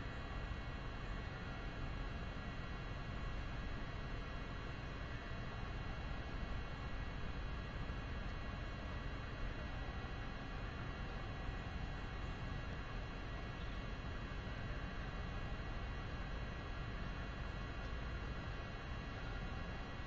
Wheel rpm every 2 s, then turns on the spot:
0, 0, 0, 0, 0, 0, 0, 0, 0, 0.
none